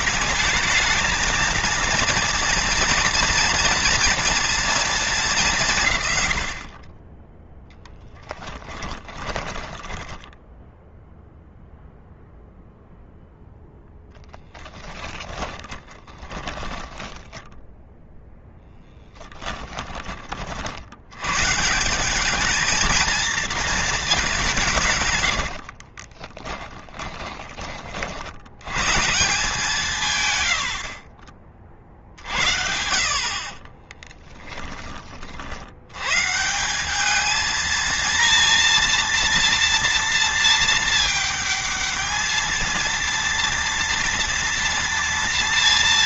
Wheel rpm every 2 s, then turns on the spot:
220, 230, 220, 40, 20, 0, 0, 40, 20, 10, 90, 220, 140, 10, 130, 60, 60, 30, 200, 230, 220, 230, 230.
8-10 14-20 24-28 30-32